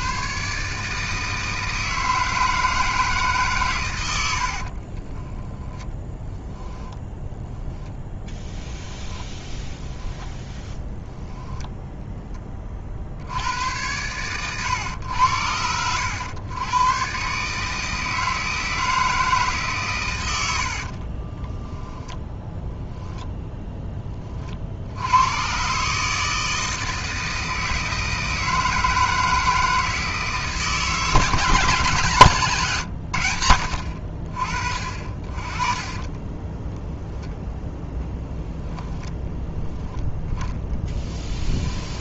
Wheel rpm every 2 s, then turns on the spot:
150, 160, 50, 10, 10, 10, 50, 100, 120, 160, 50, 0, 70, 160, 160, 160, 120, 40, 10, 10, 10.
4-6 8-10 20-22 40-42